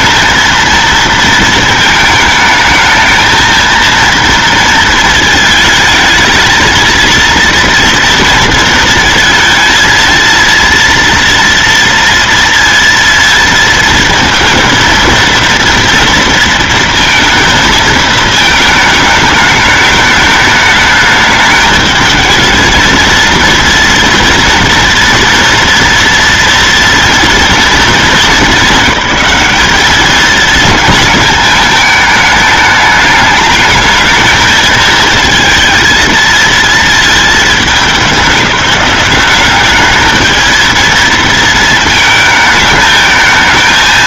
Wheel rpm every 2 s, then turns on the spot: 230, 220, 230, 220, 220, 230, 230, 220, 230, 220, 210, 220, 240, 230, 190, 220, 210, 220, 230, 200, 220, 220.
none